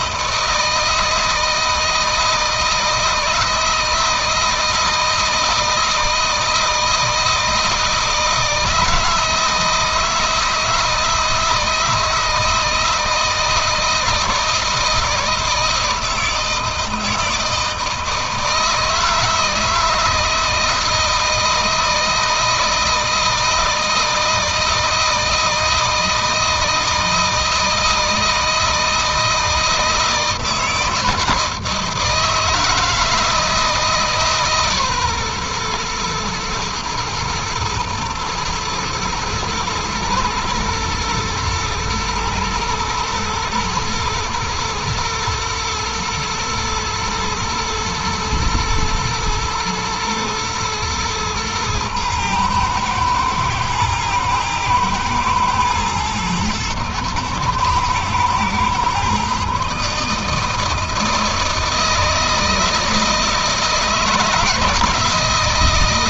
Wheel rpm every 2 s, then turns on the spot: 160, 160, 160, 160, 160, 160, 160, 160, 160, 160, 160, 160, 160, 160, 160, 160, 160, 130, 120, 110, 110, 110, 110, 110, 110, 120, 120, 110, 110, 130, 160, 160, 160.
none